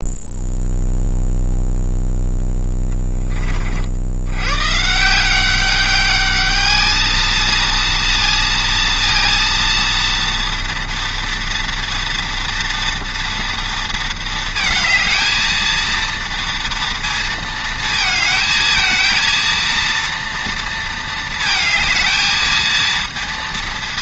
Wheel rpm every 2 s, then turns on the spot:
0, 20, 120, 210, 230, 230, 240, 220, 230, 220, 230, 220.
2-4